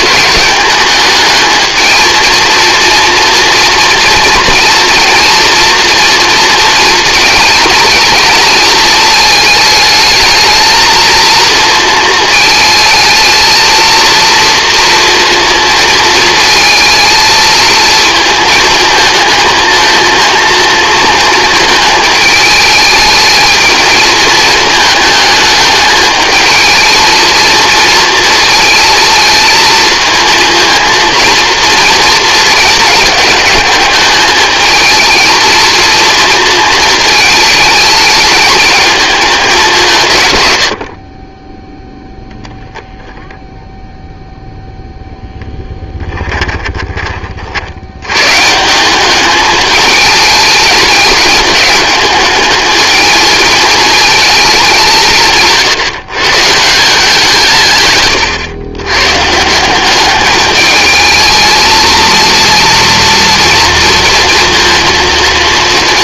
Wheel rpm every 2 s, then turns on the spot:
230, 230, 240, 220, 210, 230, 230, 230, 220, 220, 220, 220, 220, 230, 220, 230, 210, 230, 210, 140, 0, 0, 10, 70, 210, 210, 220, 150, 130, 180, 220, 230, 230.
44-46